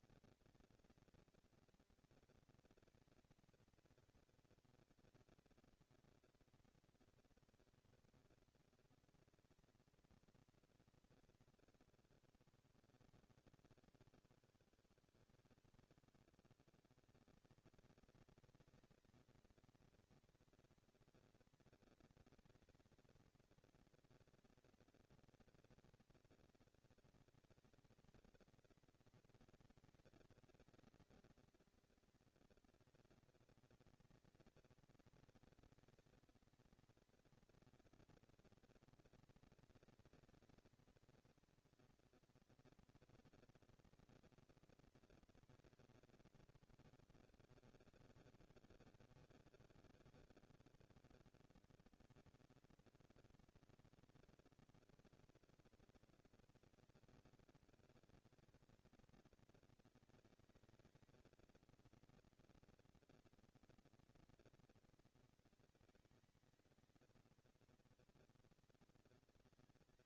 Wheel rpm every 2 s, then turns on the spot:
230, 230, 230, 230, 230, 230, 180, 160, 180, 220, 230, 230, 230, 230, 220, 220, 220, 220, 230, 230, 230, 230, 230, 200, 160, 160, 210, 230, 230, 230, 220, 230, 230, 220, 230.
none